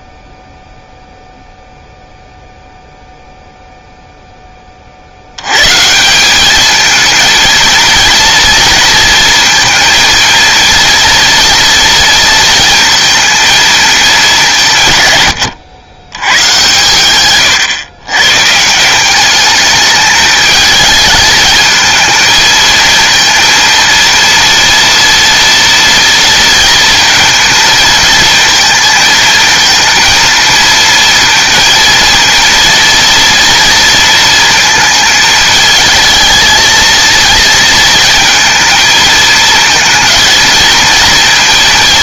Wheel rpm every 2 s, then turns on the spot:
0, 0, 30, 210, 230, 230, 230, 160, 120, 160, 210, 220, 230, 230, 230, 230, 230, 230, 220, 230, 230.
none